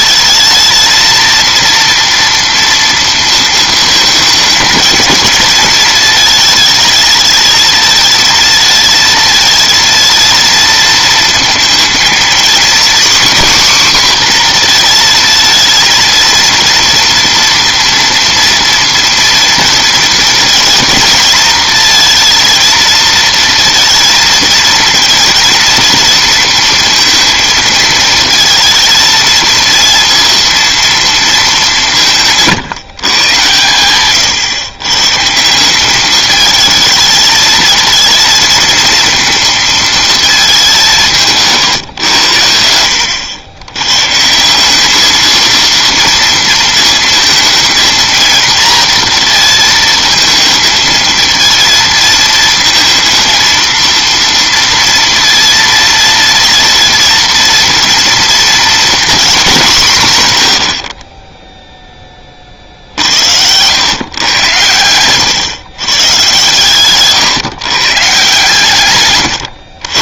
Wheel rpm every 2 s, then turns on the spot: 220, 230, 230, 220, 220, 230, 250, 230, 230, 230, 230, 230, 230, 230, 230, 230, 150, 120, 220, 220, 190, 80, 190, 230, 230, 220, 230, 230, 230, 240, 50, 50, 100, 130, 140.
42-44 64-66